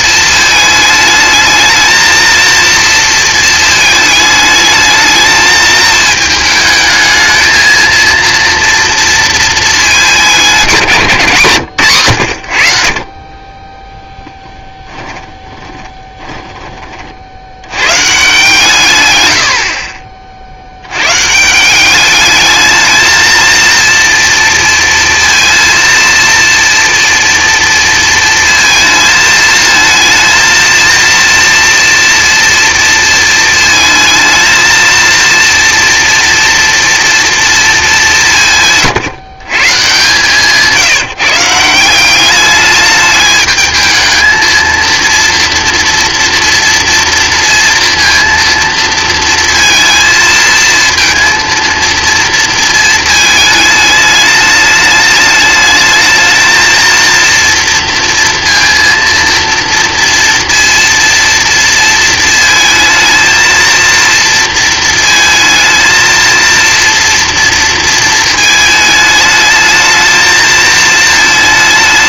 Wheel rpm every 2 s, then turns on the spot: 220, 230, 220, 220, 230, 180, 80, 10, 30, 150, 80, 220, 230, 230, 230, 230, 230, 220, 240, 160, 160, 210, 230, 230, 230, 230, 230, 210, 220, 230, 230, 220, 230, 230, 220, 220.
38-40